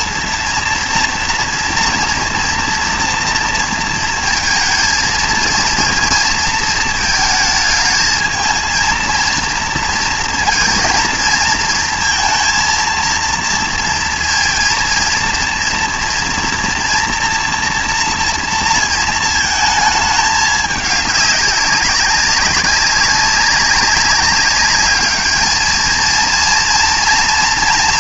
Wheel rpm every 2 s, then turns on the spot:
230, 230, 230, 230, 220, 230, 230, 230, 230, 230, 210, 190, 200, 230.
none